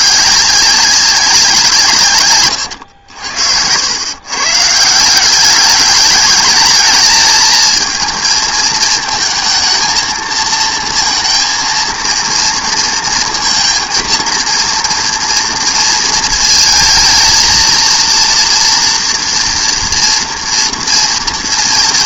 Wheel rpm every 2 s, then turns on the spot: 200, 120, 140, 220, 220, 230, 230, 230, 220, 230, 230.
2-4